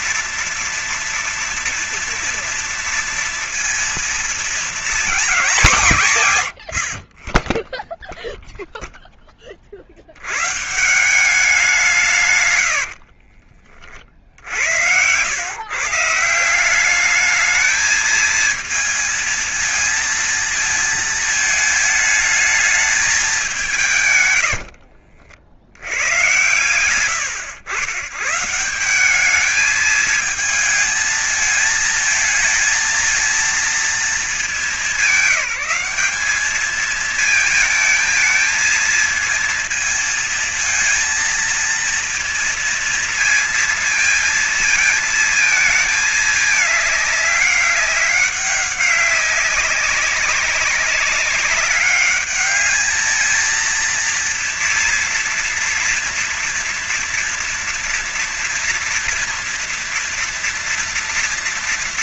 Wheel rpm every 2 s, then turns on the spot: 240, 230, 230, 110, 0, 100, 140, 60, 170, 220, 220, 220, 110, 100, 140, 220, 220, 200, 200, 220, 230, 230, 220, 220, 200, 190, 200, 230, 230, 240, 230.
12-14 24-26